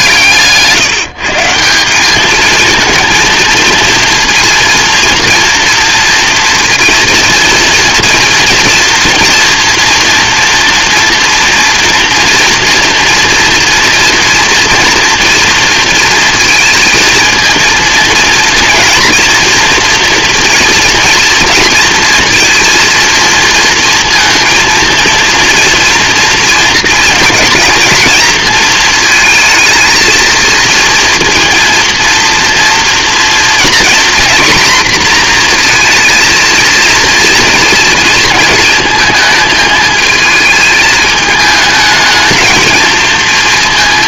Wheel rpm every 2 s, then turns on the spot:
140, 220, 230, 240, 230, 240, 240, 230, 230, 230, 230, 230, 230, 230, 220, 230, 230, 240, 230, 220, 220, 230.
none